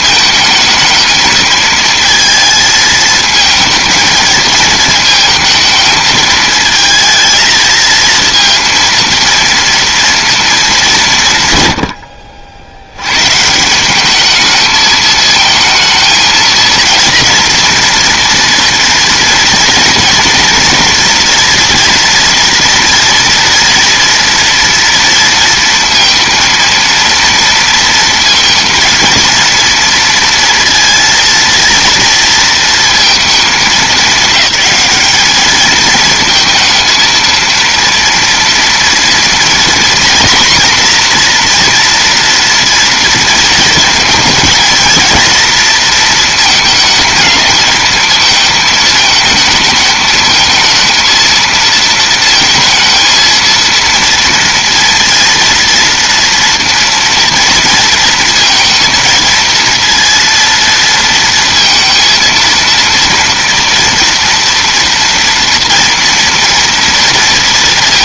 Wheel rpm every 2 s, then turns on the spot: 220, 220, 220, 220, 230, 170, 110, 220, 230, 230, 240, 230, 230, 230, 230, 230, 230, 220, 230, 240, 240, 230, 230, 220, 220, 230, 230, 230, 230, 230, 230, 230, 240, 230.
none